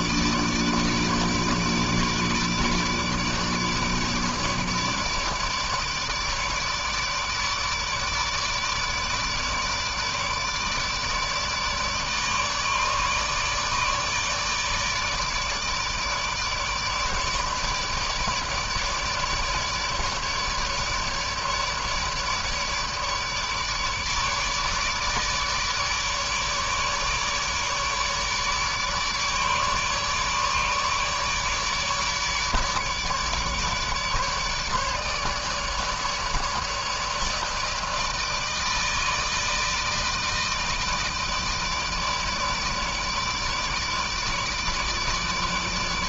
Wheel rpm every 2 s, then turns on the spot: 150, 150, 150, 150, 150, 150, 150, 150, 150, 150, 150, 150, 150, 150, 150, 150, 150, 150, 150, 160, 160, 150, 150.
none